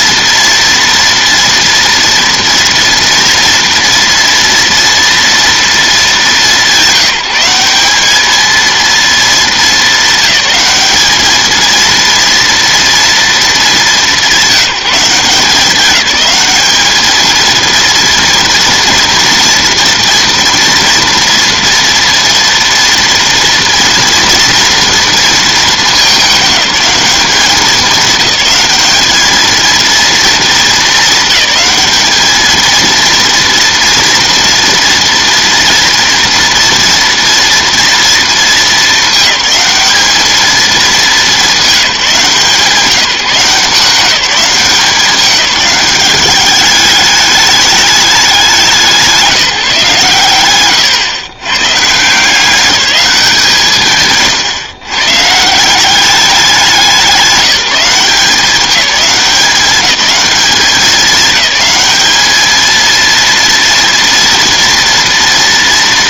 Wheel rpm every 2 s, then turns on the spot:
230, 230, 230, 200, 230, 210, 230, 190, 210, 230, 230, 230, 230, 210, 200, 220, 220, 230, 230, 220, 210, 160, 180, 210, 190, 130, 190, 140, 190, 190, 200, 220, 230.
none